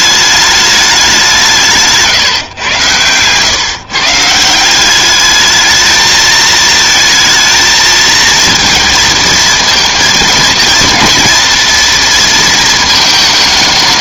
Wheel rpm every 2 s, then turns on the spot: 210, 120, 190, 220, 220, 230, 220.
none